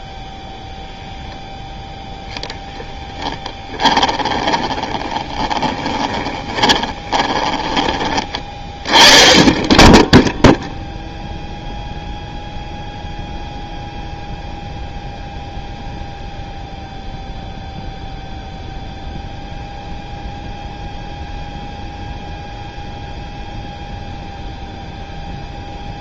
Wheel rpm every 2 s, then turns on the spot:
0, 10, 20, 20, 20, 0, 0, 0, 0, 0, 0, 0, 0.
4-8